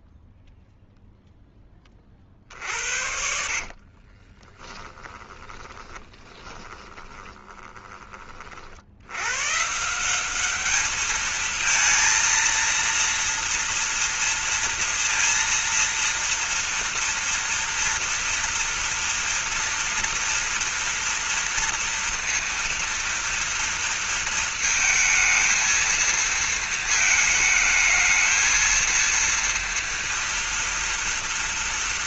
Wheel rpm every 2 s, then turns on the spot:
0, 60, 20, 20, 60, 210, 230, 230, 230, 230, 230, 230, 220, 220, 230, 230.
2-8